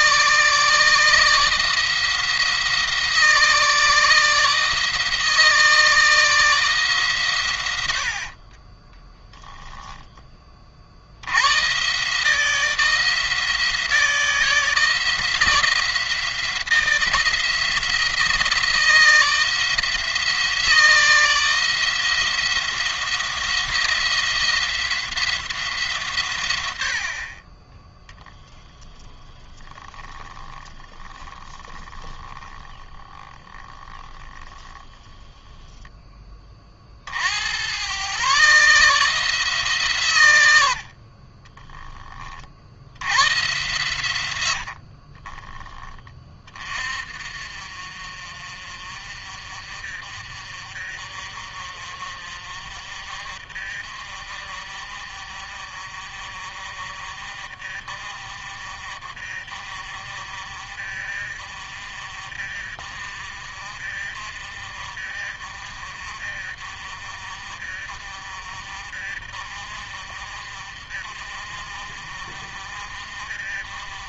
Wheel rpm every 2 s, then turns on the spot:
160, 160, 160, 150, 20, 50, 160, 170, 170, 160, 160, 170, 170, 80, 10, 20, 20, 30, 50, 150, 70, 60, 70, 40, 50, 50, 50, 50, 50, 50, 50, 50, 50, 50, 50, 50, 50.
8-10 28-36 40-42 44-46